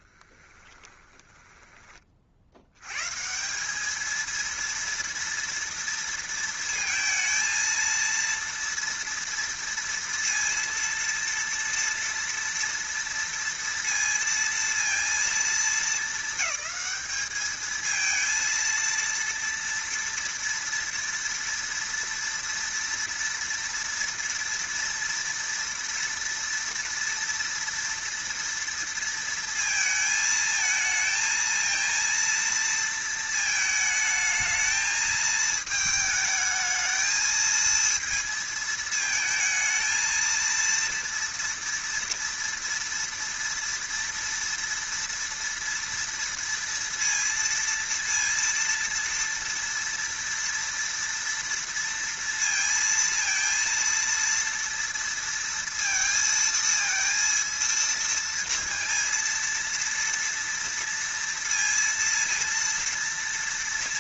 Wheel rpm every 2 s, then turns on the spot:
10, 90, 230, 230, 230, 230, 230, 230, 210, 230, 240, 230, 230, 230, 230, 220, 230, 220, 220, 220, 230, 230, 230, 230, 230, 230, 230, 230, 230, 230, 230, 230.
0-2